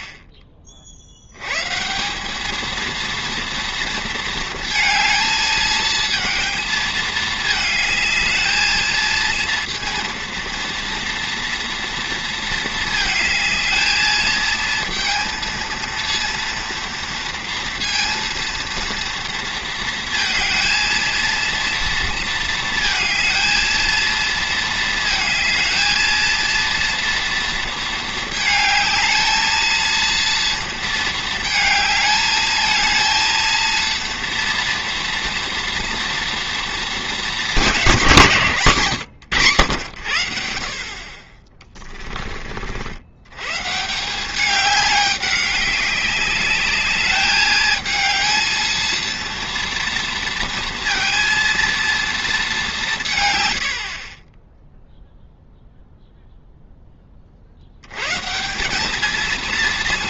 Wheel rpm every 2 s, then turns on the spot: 20, 220, 230, 220, 220, 230, 220, 220, 230, 230, 230, 230, 220, 230, 220, 230, 220, 230, 220, 150, 60, 60, 200, 210, 220, 230, 190, 0, 0, 180.
none